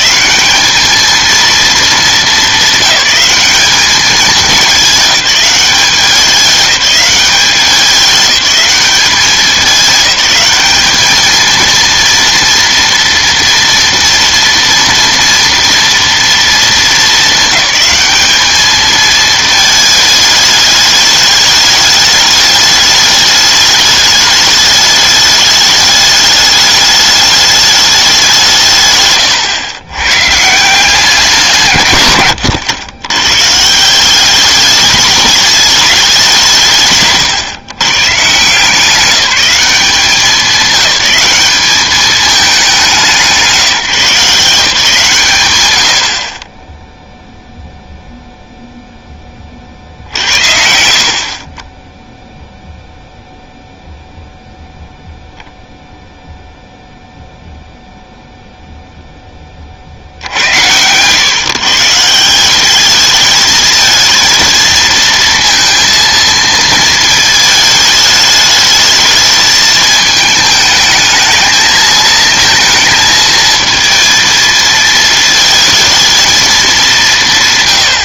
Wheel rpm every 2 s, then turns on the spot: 210, 200, 210, 200, 200, 210, 230, 230, 230, 210, 210, 210, 210, 210, 160, 160, 100, 200, 170, 160, 190, 200, 160, 20, 0, 70, 0, 0, 0, 0, 90, 190, 230, 220, 210, 220, 230, 220, 220.
none